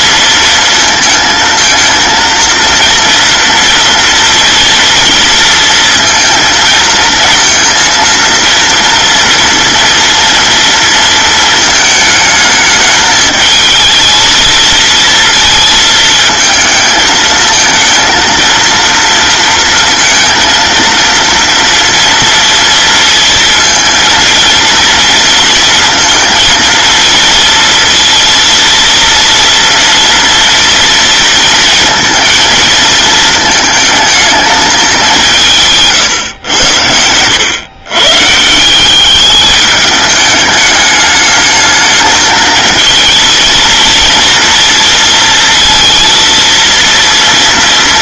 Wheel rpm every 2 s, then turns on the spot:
220, 230, 230, 230, 230, 230, 220, 220, 220, 230, 230, 230, 230, 230, 230, 230, 220, 210, 110, 170, 210, 230, 230, 230.
none